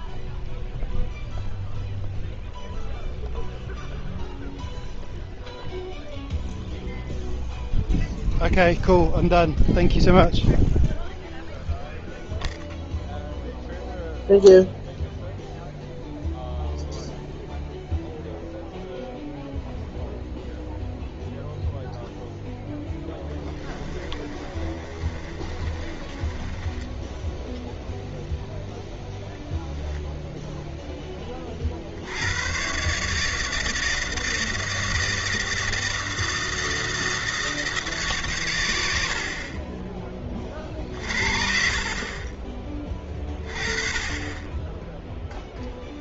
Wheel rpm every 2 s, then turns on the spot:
0, 0, 0, 0, 0, 0, 0, 0, 0, 0, 0, 0, 30, 20, 0, 0, 110, 160, 160, 110, 40, 20, 10.
24-28